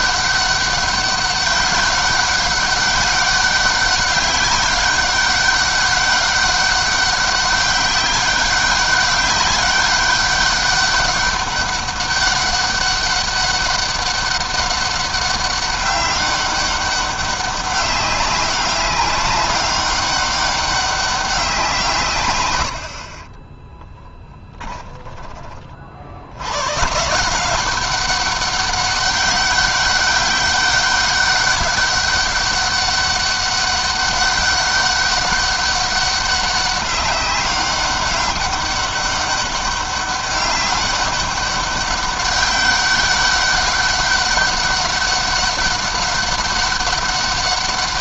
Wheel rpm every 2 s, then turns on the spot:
200, 190, 200, 200, 200, 200, 200, 200, 200, 200, 200, 110, 20, 110, 200, 200, 200, 200, 200, 200, 200, 200, 200, 200.
24-26